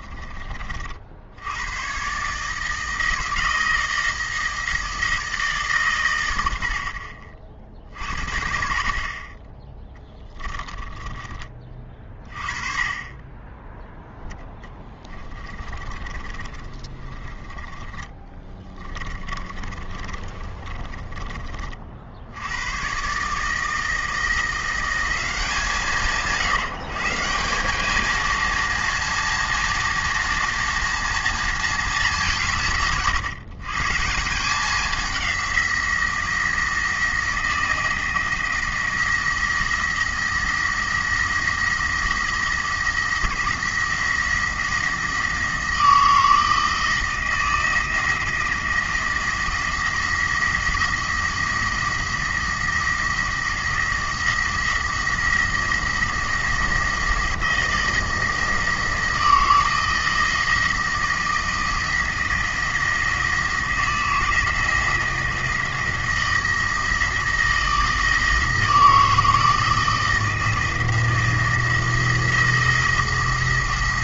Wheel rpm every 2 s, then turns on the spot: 40, 160, 160, 80, 50, 20, 30, 20, 20, 20, 30, 110, 180, 160, 230, 240, 160, 190, 170, 170, 170, 170, 160, 160, 170, 170, 170, 170, 170, 160, 170, 170, 170, 170, 160, 170, 170.
10-12 14-22